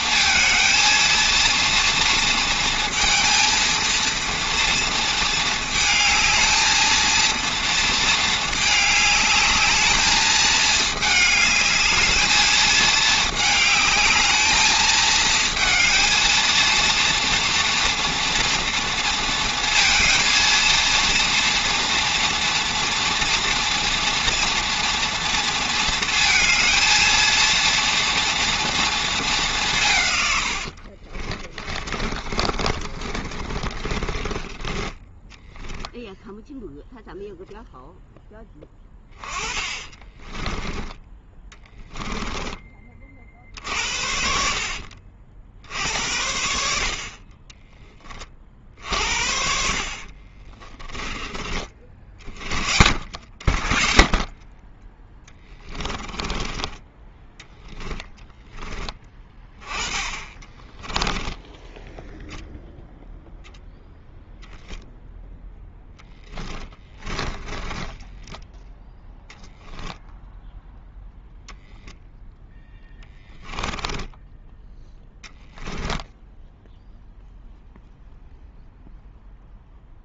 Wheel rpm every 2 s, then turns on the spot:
230, 230, 230, 220, 210, 210, 220, 220, 230, 230, 230, 230, 230, 230, 230, 80, 30, 10, 0, 10, 20, 20, 60, 60, 50, 30, 50, 20, 10, 10, 10, 0, 0, 20, 10, 0, 0, 10, 0, 0.
30-36 50-54 56-58 60-62 66-68